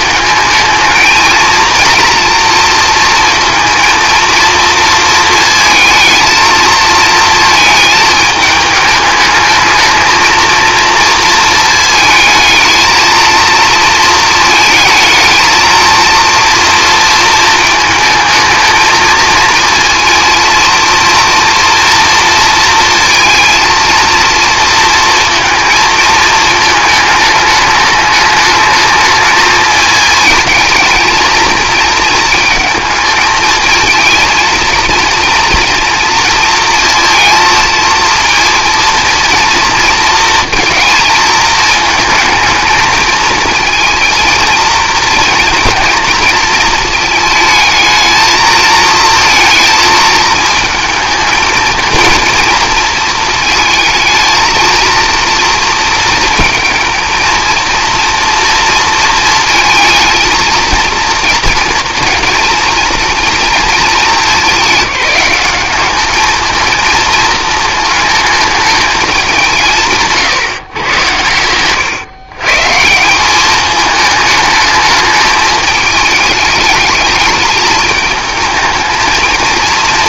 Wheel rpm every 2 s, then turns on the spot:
220, 230, 230, 220, 210, 230, 230, 220, 230, 220, 230, 230, 230, 220, 220, 220, 220, 230, 230, 230, 230, 220, 230, 220, 220, 220, 230, 230, 220, 230, 230, 230, 210, 220, 210, 110, 160, 210, 210, 220.
none